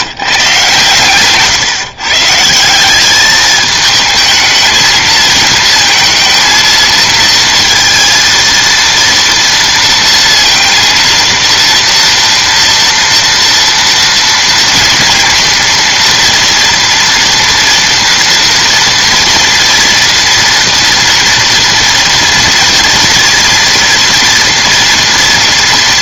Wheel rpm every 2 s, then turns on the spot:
130, 170, 220, 230, 230, 230, 230, 230, 230, 230, 230, 230, 230.
none